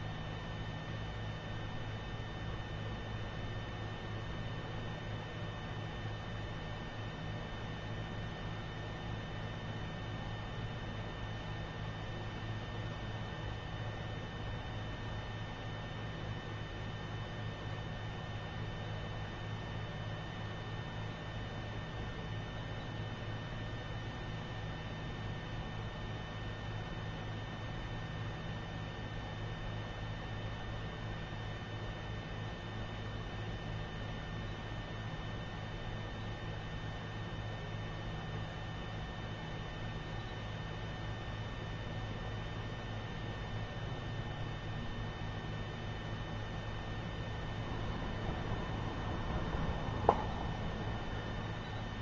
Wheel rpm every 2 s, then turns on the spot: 0, 0, 0, 0, 0, 0, 0, 0, 0, 0, 0, 0, 0, 0, 0, 0, 0, 0, 0, 0, 0, 0, 0, 0, 0, 0.
none